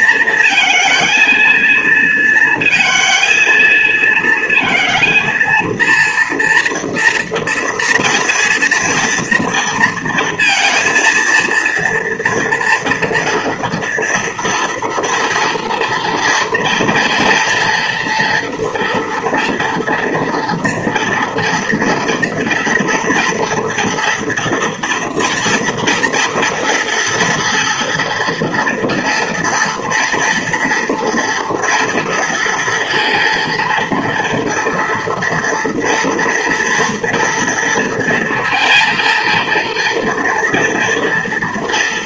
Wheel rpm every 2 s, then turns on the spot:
230, 220, 230, 230, 230, 230, 230, 230, 230, 230, 240, 230, 230, 230, 240, 230, 230, 230, 230, 230, 230.
none